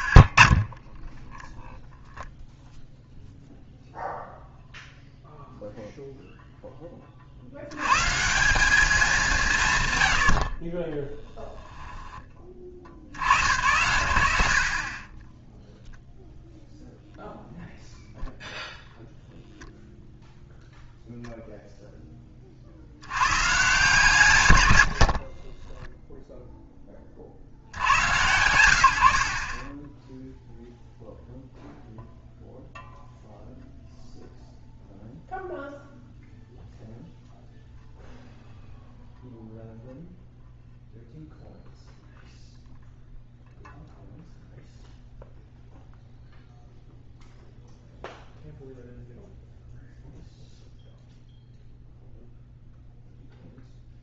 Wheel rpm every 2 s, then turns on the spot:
50, 0, 0, 20, 210, 20, 40, 40, 0, 0, 0, 60, 100, 10, 90, 0, 0, 0, 0, 0, 0, 0, 0, 0, 0, 0, 0.
none